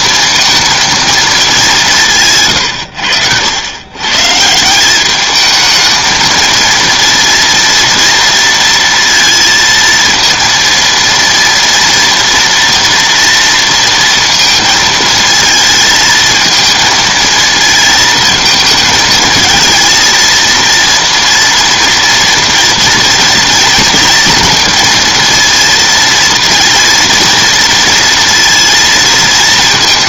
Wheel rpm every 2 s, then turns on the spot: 220, 90, 200, 230, 230, 230, 230, 220, 220, 220, 230, 230, 230, 230, 230.
none